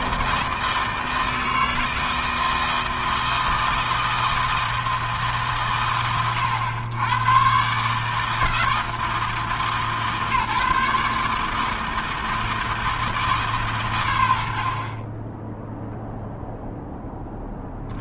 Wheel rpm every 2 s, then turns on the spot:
160, 160, 160, 70, 160, 150, 160, 60, 0.
none